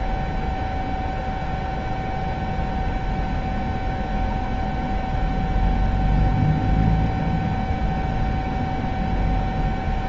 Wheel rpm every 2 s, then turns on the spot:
0, 0, 0, 0, 0.
none